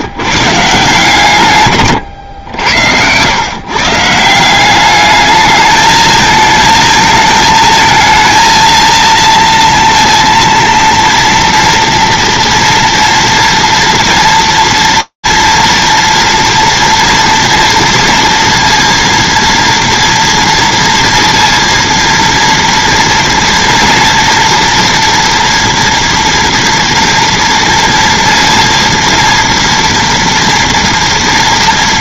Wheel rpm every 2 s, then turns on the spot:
150, 100, 190, 220, 230, 230, 230, 230, 230, 230, 240, 230, 230, 230, 230, 230.
none